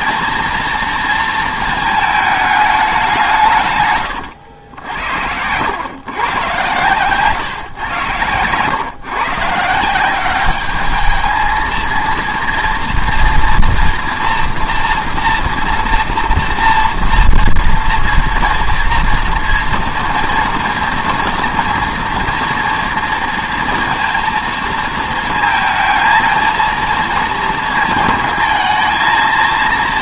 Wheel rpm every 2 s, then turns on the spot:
230, 210, 90, 120, 110, 210, 230, 230, 230, 230, 230, 230, 230, 230, 220.
6-8